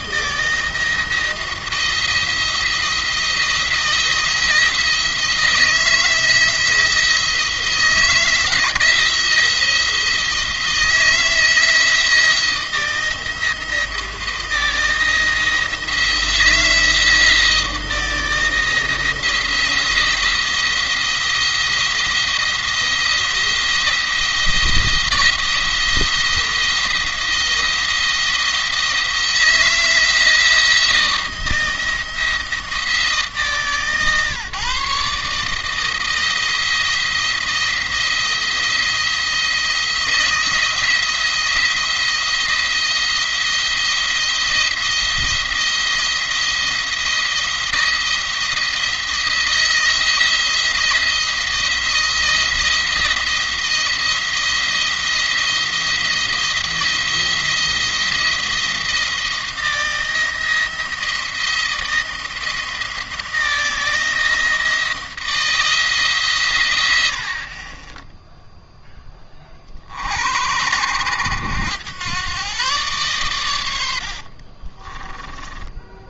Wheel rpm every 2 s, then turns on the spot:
160, 170, 170, 170, 160, 170, 170, 170, 170, 160, 170, 170, 170, 170, 160, 170, 160, 150, 170, 170, 170, 170, 170, 170, 170, 170, 170, 170, 170, 170, 170, 170, 160, 110, 0, 80, 120, 40.
74-76